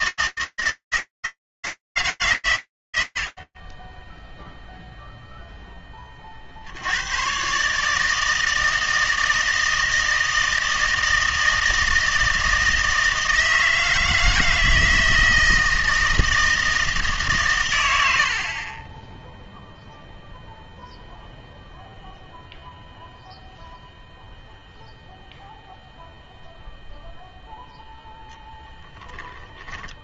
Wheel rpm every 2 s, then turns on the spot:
160, 160, 10, 60, 160, 160, 160, 160, 160, 40, 0, 0, 0, 0, 0.
none